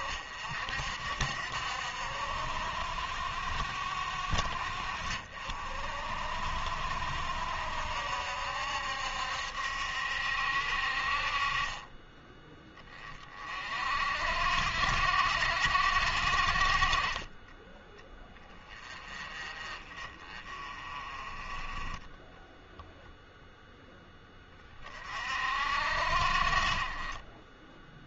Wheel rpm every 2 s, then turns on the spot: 60, 60, 60, 60, 70, 50, 20, 70, 40, 20, 30, 0, 30, 30.
none